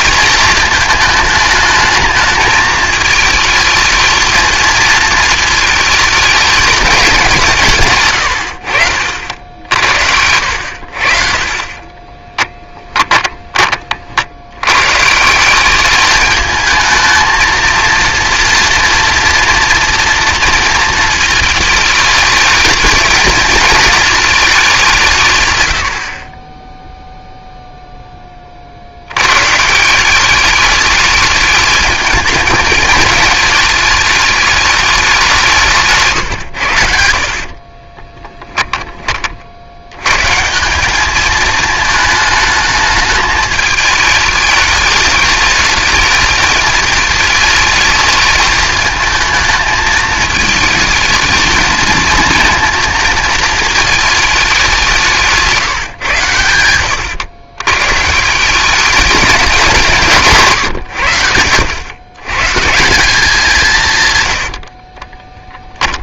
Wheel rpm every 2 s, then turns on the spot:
220, 220, 230, 200, 70, 70, 20, 130, 220, 230, 230, 220, 190, 0, 60, 210, 220, 210, 80, 20, 190, 220, 210, 210, 210, 220, 230, 190, 100, 200, 110, 180, 50.
12-14 64-66